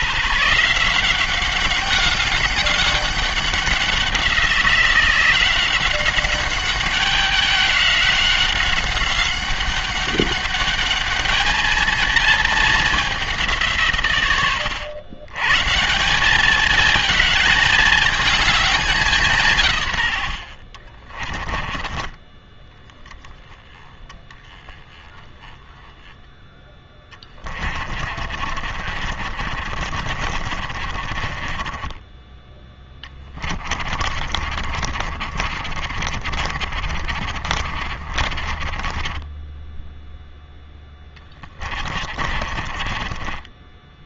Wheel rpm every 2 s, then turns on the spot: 170, 200, 170, 190, 190, 210, 210, 110, 220, 210, 50, 10, 10, 10, 50, 50, 20, 50, 40, 20, 10, 40.
20-22 28-40 42-44